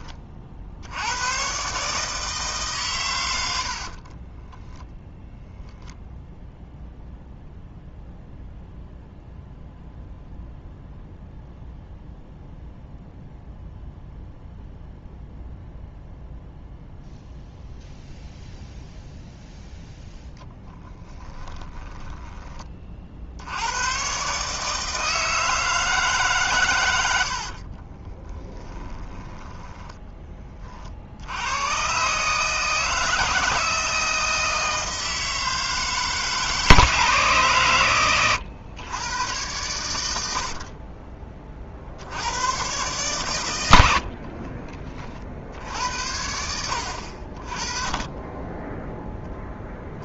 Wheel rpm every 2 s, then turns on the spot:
70, 130, 10, 0, 0, 0, 0, 0, 0, 0, 10, 30, 150, 100, 20, 50, 160, 160, 150, 110, 40, 120, 30, 70, 10.
20-22 28-30